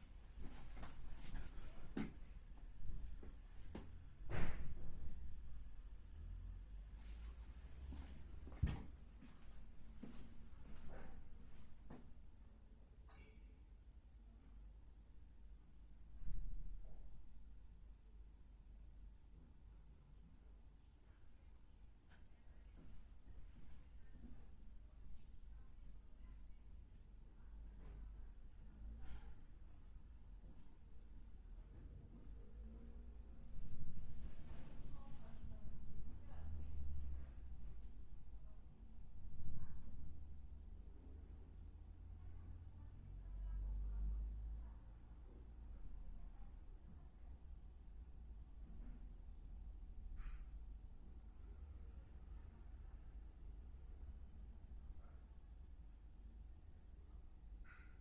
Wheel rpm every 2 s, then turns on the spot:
0, 0, 0, 0, 0, 0, 0, 0, 0, 0, 0, 0, 0, 0, 0, 0, 0, 0, 0, 0, 0, 0, 0, 0, 0, 0, 0, 0, 0.
none